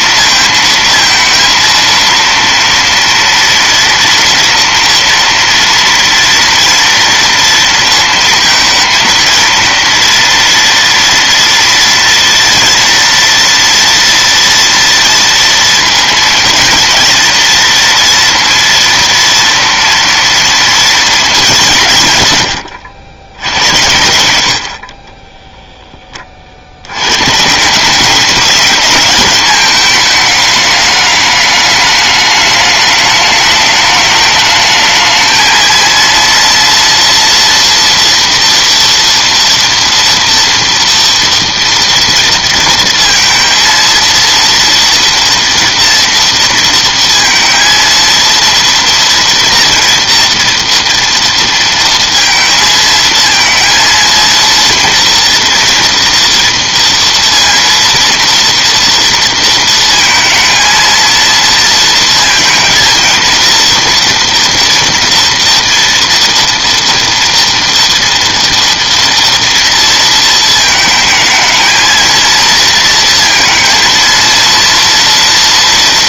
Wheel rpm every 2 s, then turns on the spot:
230, 230, 240, 230, 230, 230, 230, 230, 230, 230, 180, 80, 0, 160, 210, 210, 210, 220, 230, 230, 230, 230, 230, 230, 230, 230, 230, 230, 230, 230, 230, 230, 230, 230, 230, 230, 230, 230.
none